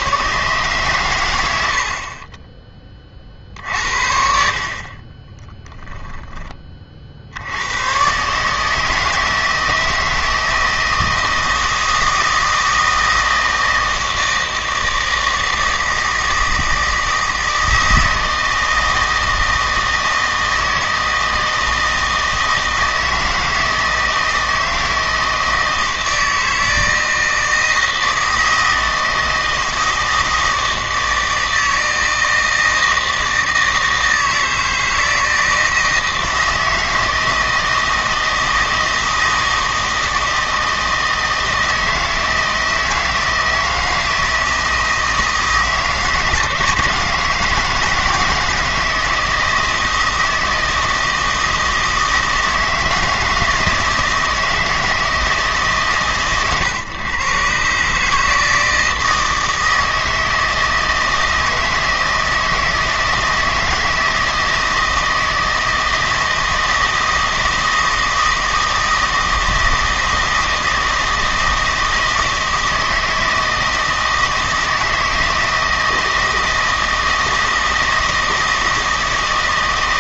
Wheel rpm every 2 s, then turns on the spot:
130, 20, 50, 30, 150, 160, 160, 160, 160, 160, 160, 160, 160, 160, 160, 160, 160, 160, 160, 160, 160, 170, 160, 160, 160, 160, 160, 160, 130, 160, 160, 160, 160, 160, 160, 160, 160, 160, 160, 160.
none